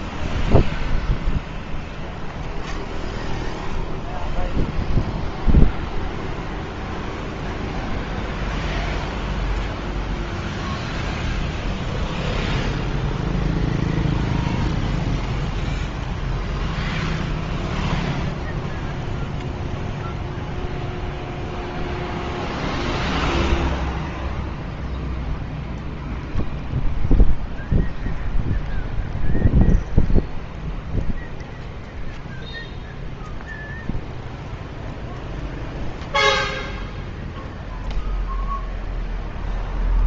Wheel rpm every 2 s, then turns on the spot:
0, 0, 0, 0, 0, 0, 0, 0, 0, 0, 0, 0, 0, 0, 0, 0, 0, 0, 0, 0.
none